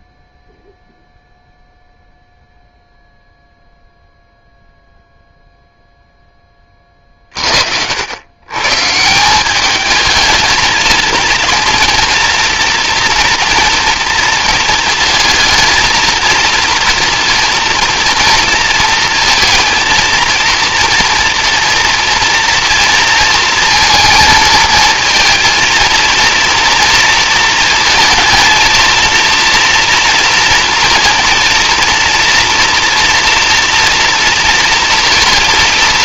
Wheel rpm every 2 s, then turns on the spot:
0, 0, 0, 30, 150, 230, 230, 220, 230, 230, 230, 230, 230, 230, 230, 230, 230, 230.
6-8